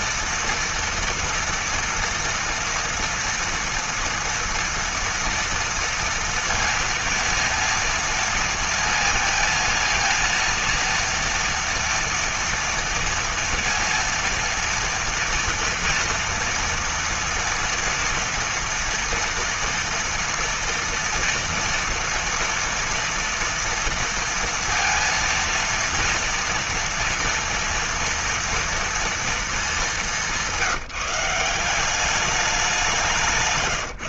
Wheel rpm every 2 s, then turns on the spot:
230, 230, 240, 230, 230, 230, 230, 230, 230, 230, 230, 230, 230, 230, 230, 190, 190.
none